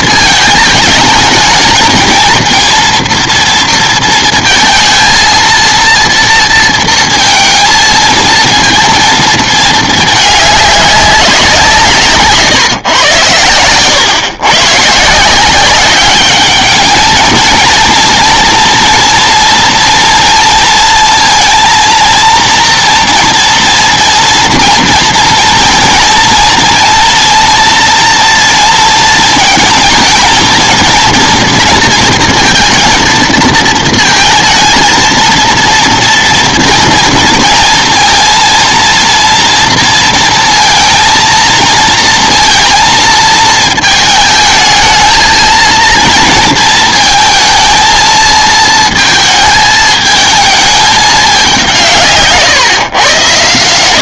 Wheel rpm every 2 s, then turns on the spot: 220, 230, 230, 230, 230, 200, 130, 140, 210, 230, 230, 230, 230, 230, 230, 230, 230, 230, 230, 230, 230, 230, 220, 220, 220, 210, 130.
none